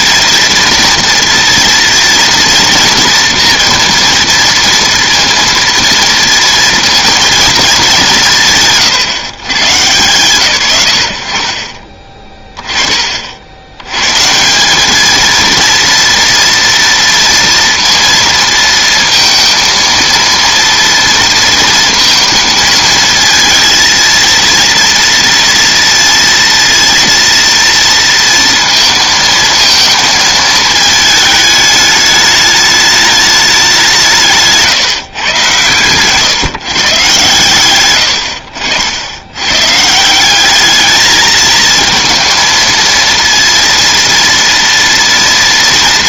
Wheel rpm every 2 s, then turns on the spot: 230, 230, 230, 230, 150, 100, 30, 190, 230, 230, 230, 230, 230, 230, 230, 220, 210, 150, 140, 70, 210, 230, 230.
none